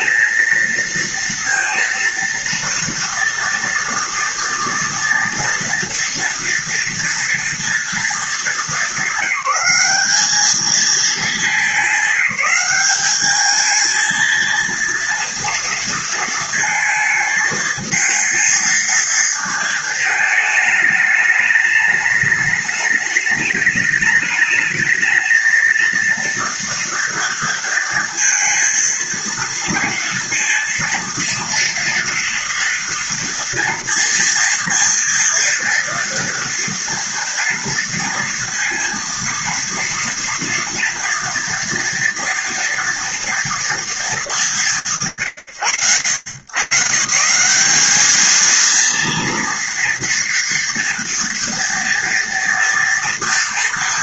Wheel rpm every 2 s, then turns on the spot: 220, 230, 230, 230, 220, 200, 210, 220, 230, 230, 220, 210, 210, 230, 230, 230, 230, 230, 230, 230, 240, 230, 220, 120, 220, 230, 230.
none